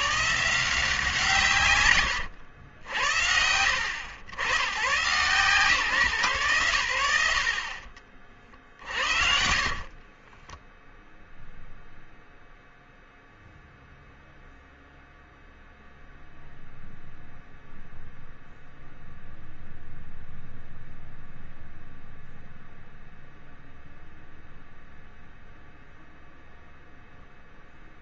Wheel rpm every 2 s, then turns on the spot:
180, 90, 110, 100, 50, 0, 0, 0, 0, 0, 0, 0, 0, 0.
8-10